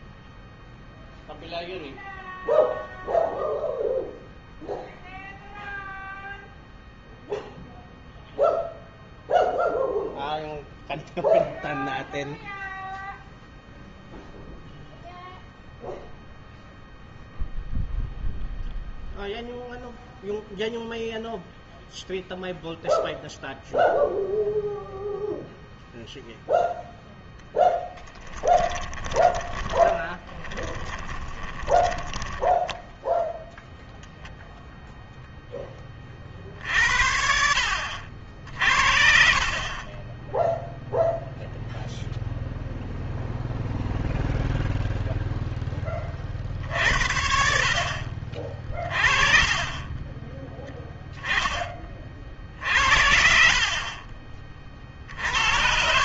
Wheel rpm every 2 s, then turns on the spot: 0, 0, 0, 0, 0, 0, 0, 0, 0, 0, 0, 0, 0, 0, 10, 20, 10, 0, 50, 60, 0, 0, 0, 60, 40, 0, 50, 40.
28-32 48-50